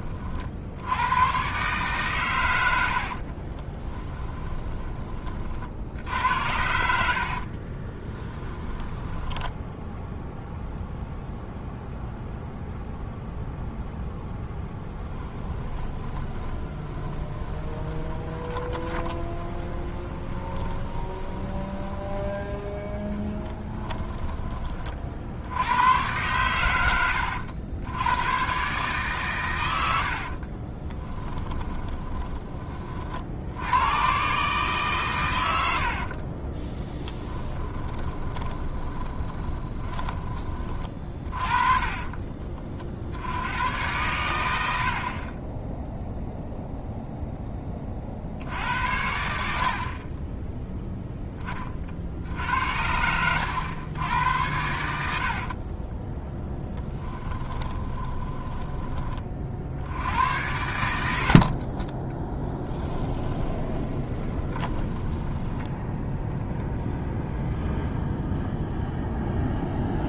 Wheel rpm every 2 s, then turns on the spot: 80, 90, 20, 60, 10, 0, 0, 10, 20, 20, 20, 10, 30, 100, 130, 30, 30, 140, 20, 20, 30, 50, 80, 0, 70, 10, 80, 70, 10, 10, 80, 10, 10, 0, 0.
4-6 8-10 14-22 30-32 38-40 52-54 56-58 62-66